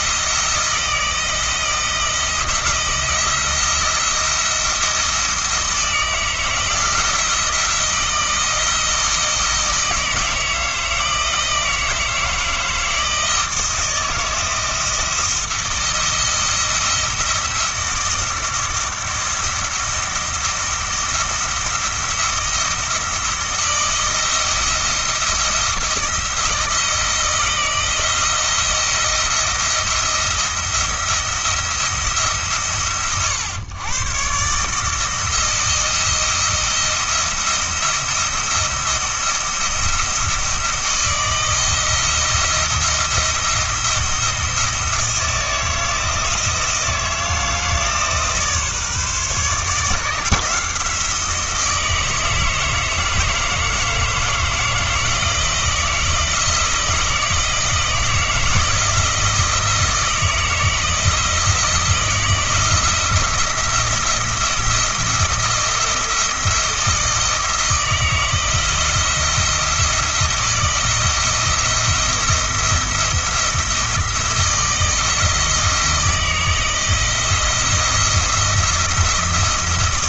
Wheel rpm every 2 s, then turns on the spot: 170, 170, 170, 160, 170, 160, 160, 170, 170, 170, 170, 170, 170, 160, 170, 170, 130, 150, 170, 170, 160, 170, 170, 170, 150, 170, 160, 160, 160, 160, 160, 170, 160, 160, 170, 170, 170, 170, 160, 170.
none